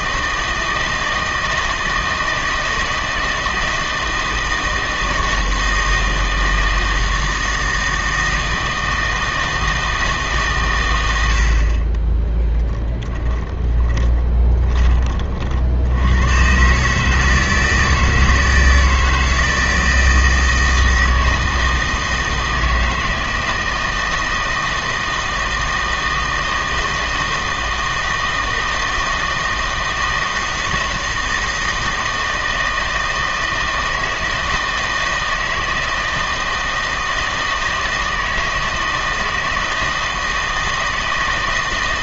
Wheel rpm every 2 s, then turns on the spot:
160, 160, 160, 160, 160, 130, 10, 20, 140, 160, 160, 160, 160, 160, 160, 160, 160, 160, 160, 160, 160.
12-14